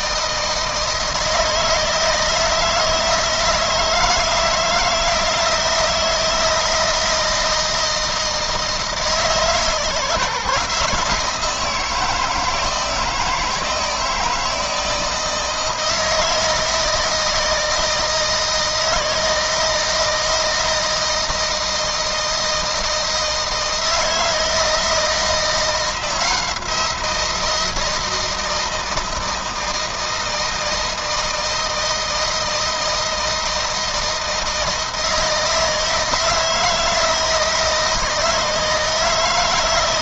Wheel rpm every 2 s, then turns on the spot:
160, 160, 170, 160, 160, 160, 160, 160, 160, 160, 160, 160, 160, 170, 160, 160, 160, 160, 160, 160.
none